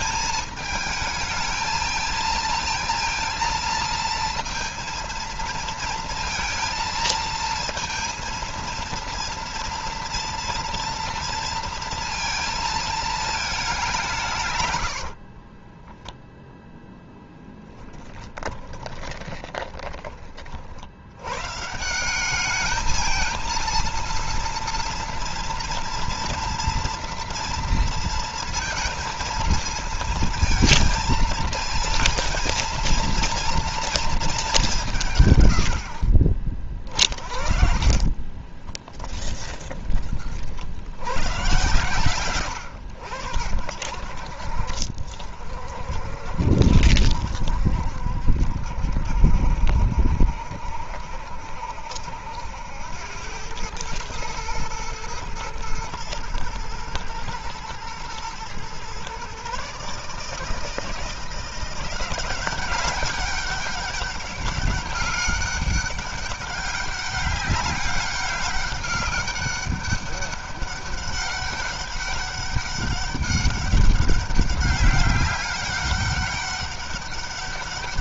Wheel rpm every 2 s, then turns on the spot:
220, 230, 230, 230, 230, 230, 220, 80, 0, 20, 80, 220, 230, 230, 230, 230, 230, 170, 30, 20, 70, 90, 60, 70, 70, 70, 90, 110, 110, 120, 160, 190, 190, 200, 200, 200, 200, 200, 200.
14-16 18-20 36-40